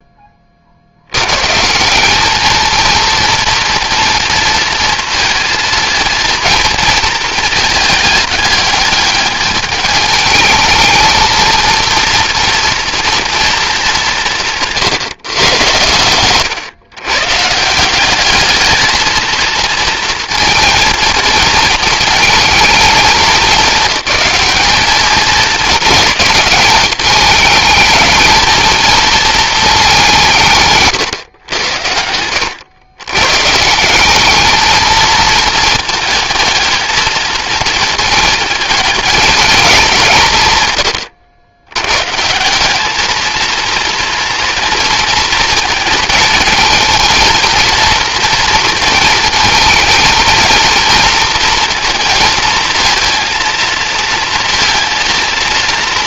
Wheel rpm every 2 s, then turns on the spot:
120, 230, 230, 220, 210, 220, 230, 130, 140, 220, 230, 210, 210, 210, 220, 110, 140, 220, 220, 220, 80, 220, 230, 230, 230, 230, 230, 230.
none